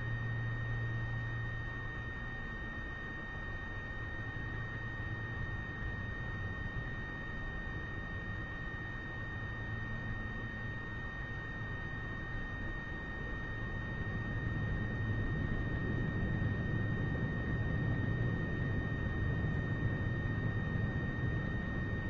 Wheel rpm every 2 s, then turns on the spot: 0, 0, 0, 0, 0, 0, 0, 0, 0, 0, 0.
none